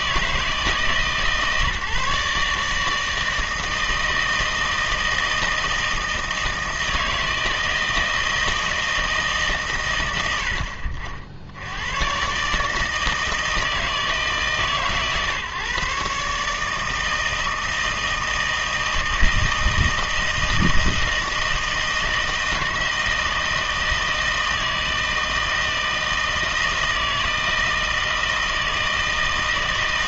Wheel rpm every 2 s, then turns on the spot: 150, 150, 160, 160, 160, 60, 150, 140, 150, 160, 160, 160, 160, 160, 160.
none